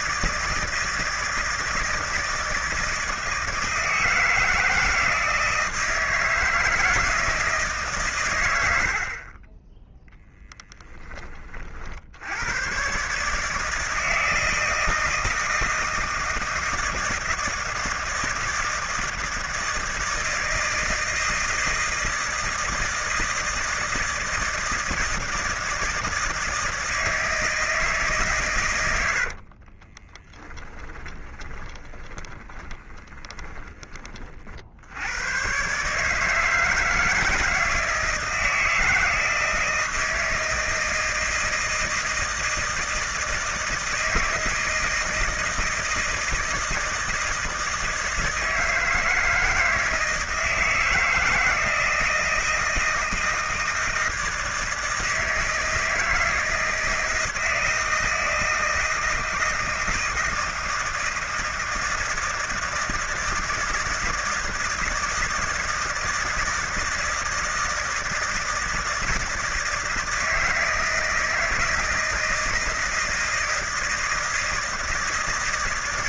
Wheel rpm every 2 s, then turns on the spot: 160, 160, 160, 170, 90, 20, 100, 160, 160, 160, 160, 160, 160, 160, 120, 20, 20, 60, 160, 170, 160, 160, 160, 160, 160, 160, 170, 160, 160, 160, 160, 160, 160, 160, 160, 160, 160, 160.
30-34